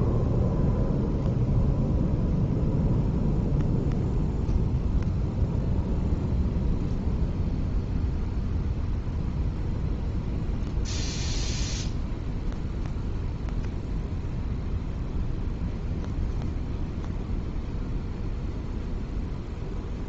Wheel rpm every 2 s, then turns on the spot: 0, 0, 0, 0, 0, 0, 0, 0, 0, 0.
none